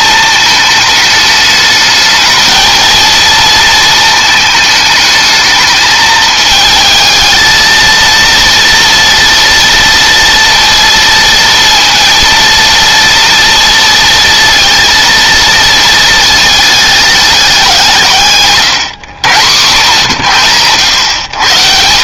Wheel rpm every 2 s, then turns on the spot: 210, 230, 220, 220, 230, 230, 230, 230, 220, 120, 100.
none